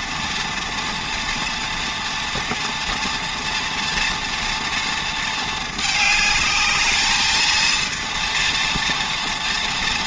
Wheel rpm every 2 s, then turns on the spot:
240, 230, 230, 210, 230.
none